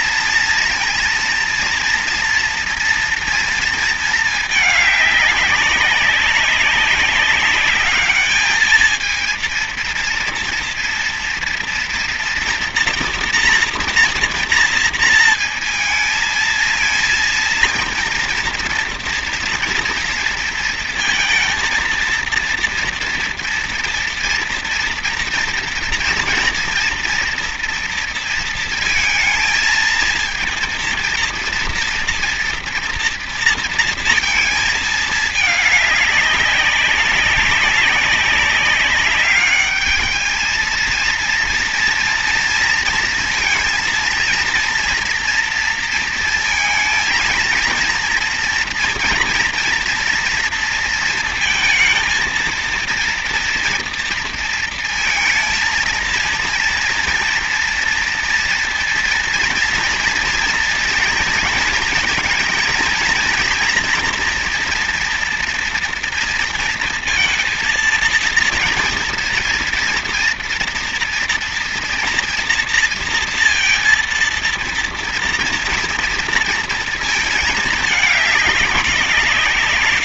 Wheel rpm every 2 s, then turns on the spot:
230, 230, 220, 200, 220, 230, 230, 230, 230, 230, 230, 230, 230, 230, 230, 230, 230, 230, 200, 200, 220, 230, 230, 230, 230, 230, 230, 230, 230, 230, 230, 230, 230, 230, 230, 230, 230, 230, 230, 200.
none